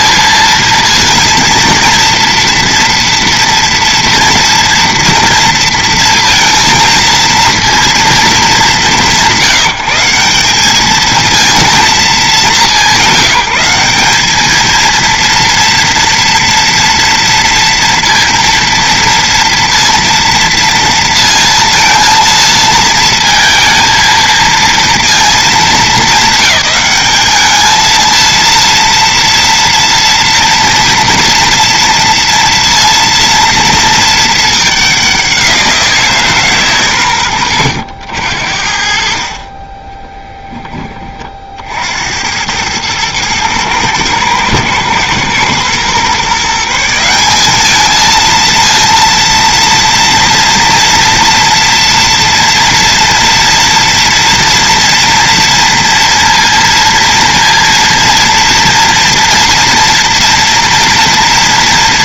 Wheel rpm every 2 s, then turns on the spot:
230, 230, 240, 230, 200, 210, 200, 230, 230, 230, 230, 230, 230, 200, 230, 230, 230, 210, 140, 60, 10, 100, 120, 170, 230, 230, 230, 240, 230, 230, 230.
none